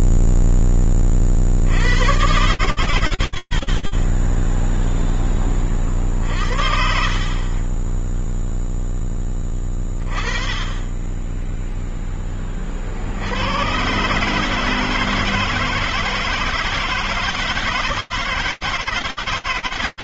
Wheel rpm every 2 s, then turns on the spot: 0, 50, 40, 50, 10, 30, 10, 140, 160, 160.
none